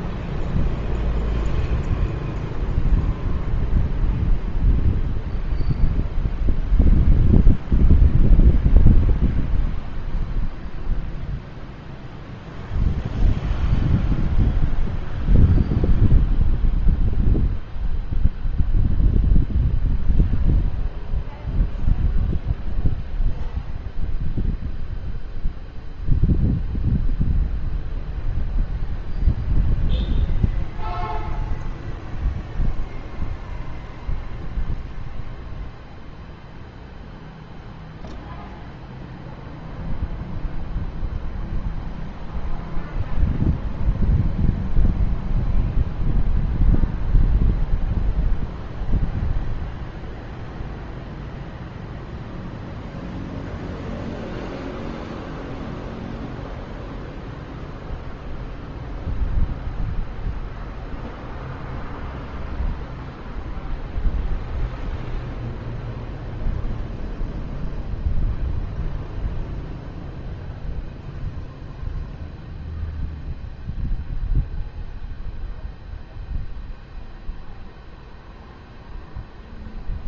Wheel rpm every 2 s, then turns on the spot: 0, 0, 0, 0, 0, 0, 0, 0, 0, 0, 0, 0, 0, 0, 0, 0, 0, 0, 0, 0, 0, 0, 0, 0, 0, 0, 0, 0, 0, 0, 0, 0, 0, 0, 0, 0, 0, 0, 0, 0.
none